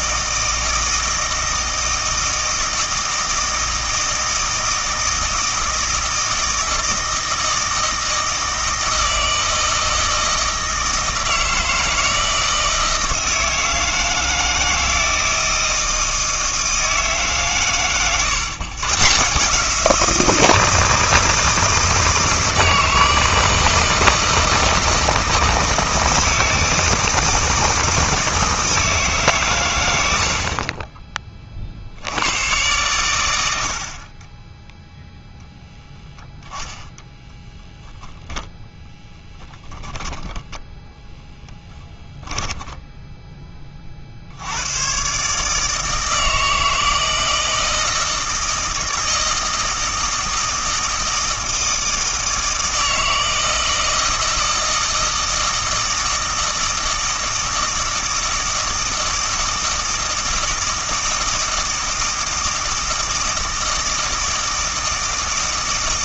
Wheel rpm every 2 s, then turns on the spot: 160, 160, 160, 160, 160, 160, 160, 160, 160, 130, 160, 160, 160, 160, 160, 30, 110, 10, 10, 0, 0, 10, 100, 160, 160, 160, 160, 160, 160, 160, 160, 160, 160.
none